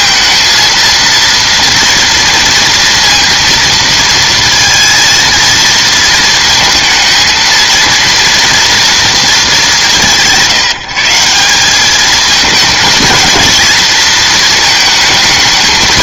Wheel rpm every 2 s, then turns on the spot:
230, 230, 230, 220, 230, 160, 220, 220.
none